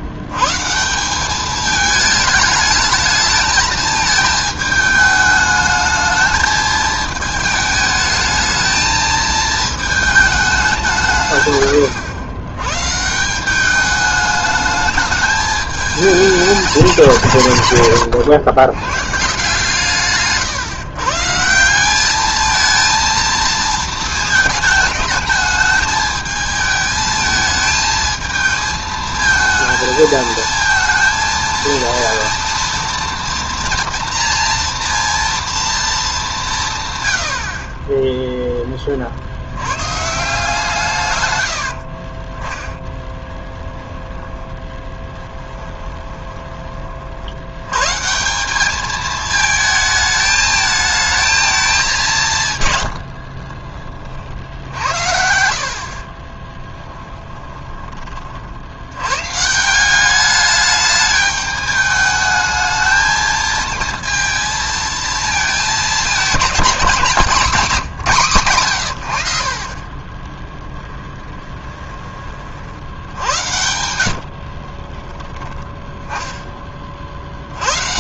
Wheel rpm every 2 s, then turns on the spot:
130, 220, 220, 220, 220, 190, 120, 210, 200, 100, 140, 220, 220, 220, 220, 220, 230, 230, 150, 20, 150, 10, 20, 30, 200, 220, 140, 60, 20, 70, 210, 220, 230, 200, 120, 30, 50, 50, 10.
44-46 56-58 70-72 74-76